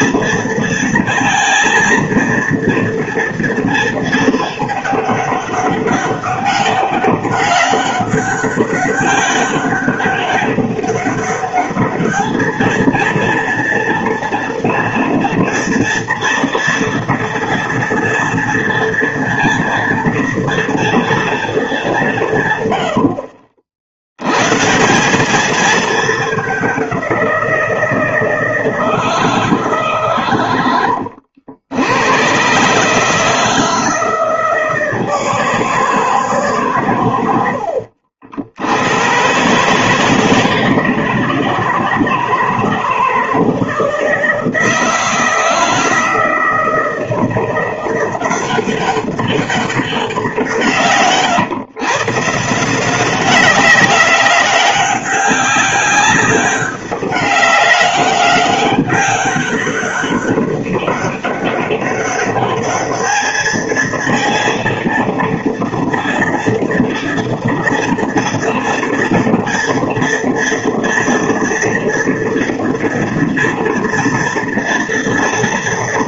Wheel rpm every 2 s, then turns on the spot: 230, 230, 210, 200, 200, 200, 230, 240, 230, 230, 230, 80, 170, 190, 160, 90, 150, 160, 110, 100, 160, 160, 160, 160, 190, 150, 180, 190, 200, 200, 200, 210, 230, 230, 230, 230, 240, 230.
none